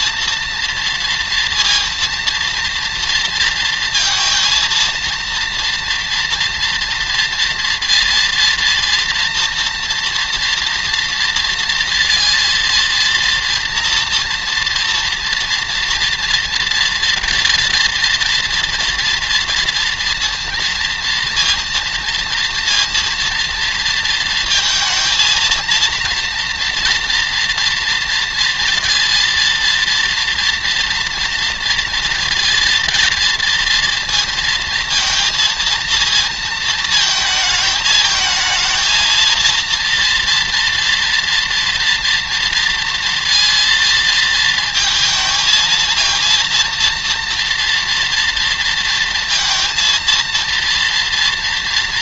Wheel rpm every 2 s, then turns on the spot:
230, 230, 230, 230, 240, 230, 230, 230, 230, 230, 230, 230, 230, 230, 230, 240, 230, 230, 230, 220, 230, 230, 220, 230, 230, 230.
none